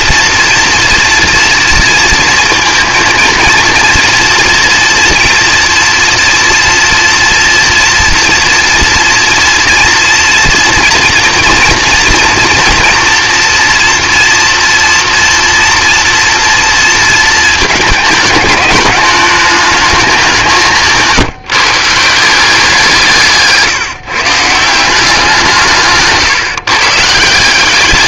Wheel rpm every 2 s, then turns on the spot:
230, 230, 230, 230, 230, 230, 230, 230, 230, 210, 170, 180, 170, 140.
none